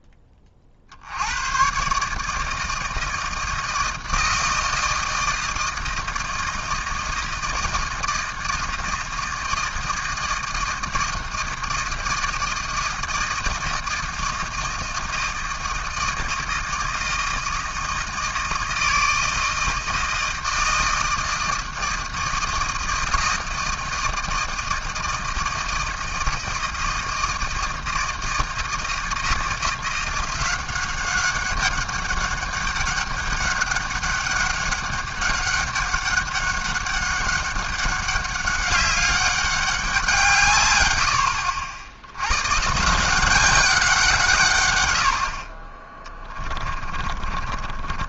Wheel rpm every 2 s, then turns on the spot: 50, 160, 160, 160, 160, 160, 160, 160, 160, 160, 160, 160, 160, 160, 160, 180, 200, 200, 200, 200, 120, 140, 120, 40.
46-48